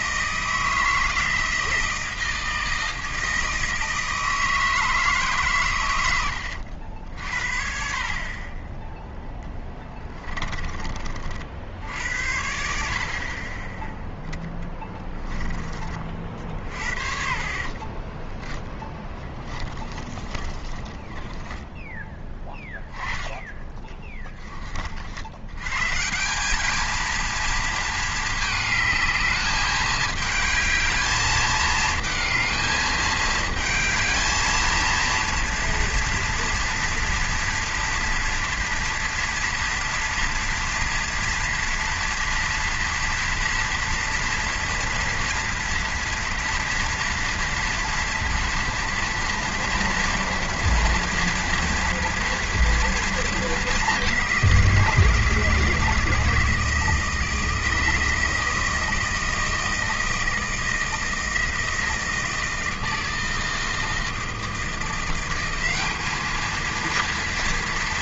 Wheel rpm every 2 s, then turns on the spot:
170, 160, 160, 80, 20, 20, 70, 10, 50, 10, 20, 10, 30, 200, 210, 210, 220, 220, 230, 230, 230, 230, 230, 230, 230, 230, 230, 180, 160, 160, 160, 160, 170, 220.
16-22